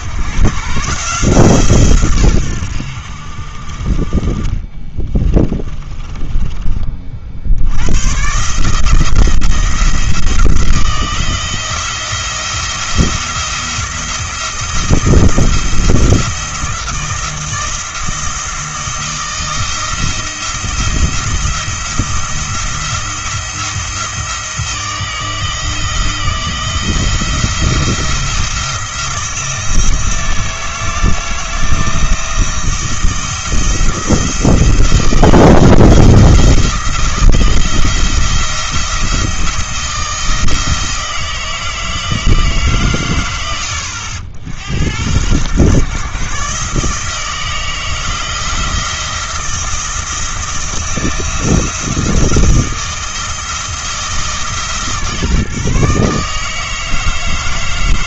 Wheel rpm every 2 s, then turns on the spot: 140, 80, 30, 20, 150, 160, 170, 170, 170, 160, 170, 170, 160, 170, 170, 170, 170, 160, 170, 170, 160, 140, 90, 150, 160, 160, 160, 150, 160.
4-6